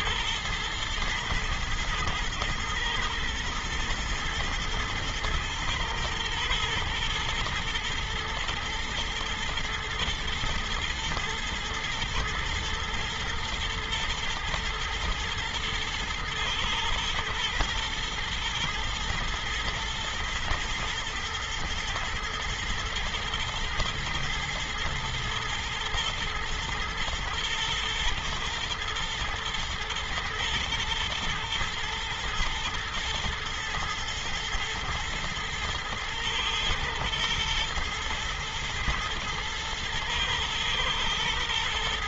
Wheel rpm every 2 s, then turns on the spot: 110, 110, 110, 120, 120, 120, 120, 120, 110, 110, 120, 110, 110, 110, 120, 120, 120, 120, 110, 120, 120.
none